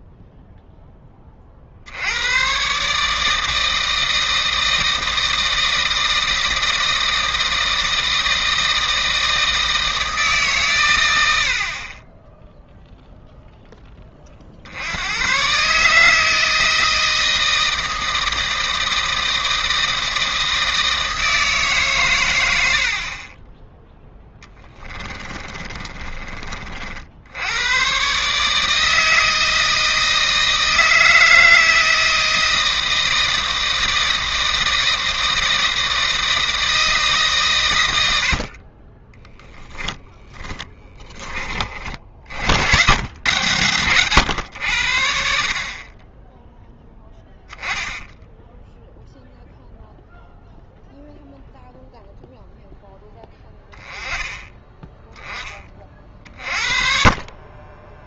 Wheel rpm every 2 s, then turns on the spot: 10, 140, 160, 160, 160, 120, 0, 90, 160, 160, 160, 70, 20, 60, 160, 160, 160, 160, 160, 20, 20, 90, 80, 0, 10, 0, 10, 10, 40.
22-26 38-40